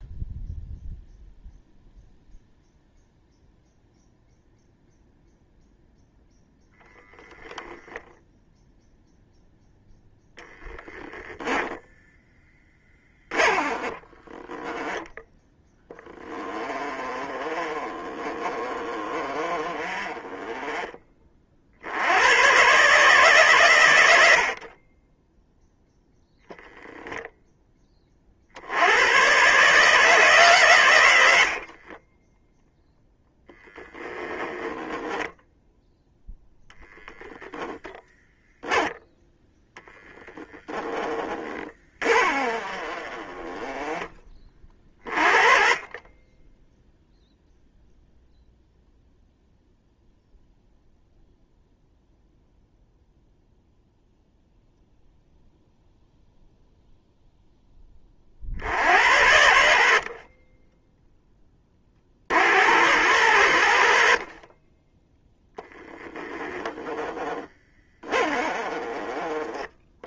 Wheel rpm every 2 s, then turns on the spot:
0, 0, 0, 0, 0, 10, 10, 10, 20, 30, 30, 140, 40, 10, 90, 110, 0, 10, 0, 0, 10, 30, 30, 0, 0, 0, 0, 0, 0, 70, 10, 90, 20, 10, 20.
16-20 34-36 42-44 68-70